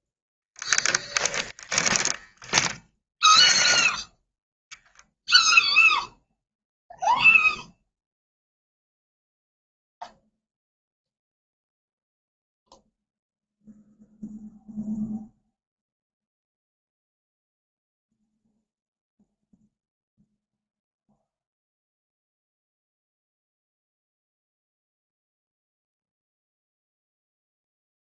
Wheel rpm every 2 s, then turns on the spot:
10, 10, 0, 0, 0, 0, 0, 0, 0, 0, 0, 0, 0, 0.
none